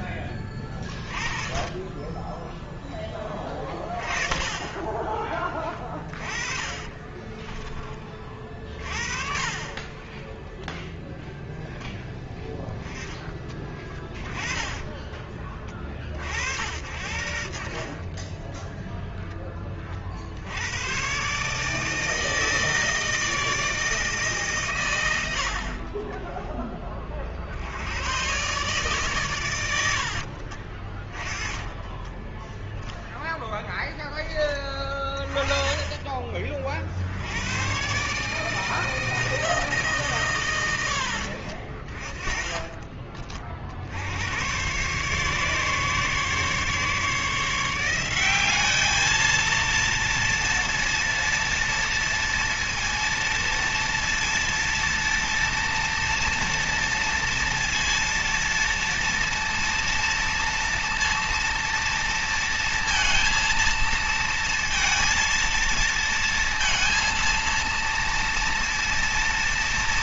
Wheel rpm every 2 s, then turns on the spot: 20, 10, 30, 30, 40, 0, 10, 20, 70, 10, 110, 160, 100, 40, 130, 40, 0, 20, 70, 160, 80, 30, 130, 150, 220, 230, 230, 230, 230, 230, 230, 230, 230, 230, 230.
4-10 16-18 30-32